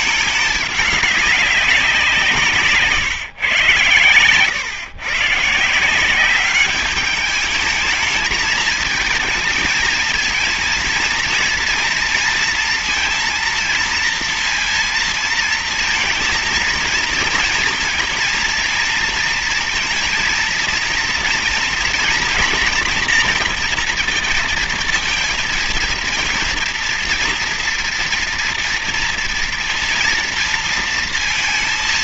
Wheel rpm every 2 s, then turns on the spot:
200, 150, 130, 200, 220, 230, 230, 230, 230, 230, 230, 230, 230, 230, 230, 230.
none